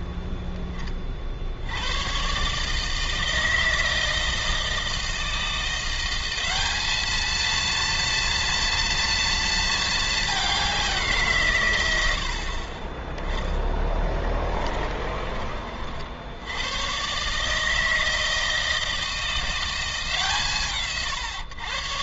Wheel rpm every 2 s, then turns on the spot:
20, 150, 160, 200, 240, 190, 30, 20, 100, 160, 120.
14-16